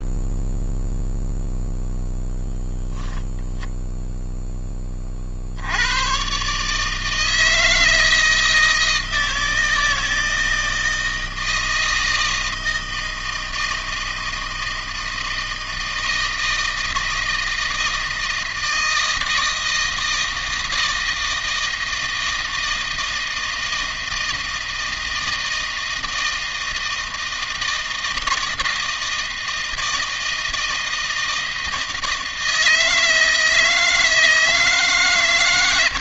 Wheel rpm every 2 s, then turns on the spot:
0, 0, 10, 140, 160, 160, 160, 160, 160, 160, 160, 160, 160, 160, 160, 160, 160, 150.
none